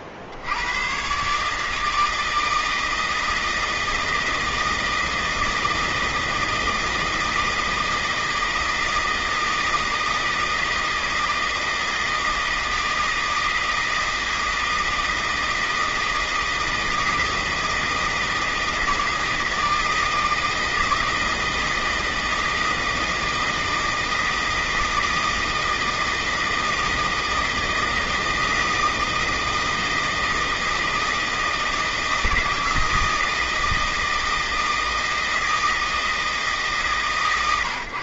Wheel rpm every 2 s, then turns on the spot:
100, 160, 160, 160, 160, 160, 160, 160, 160, 160, 160, 160, 160, 160, 160, 160, 160, 160, 160.
none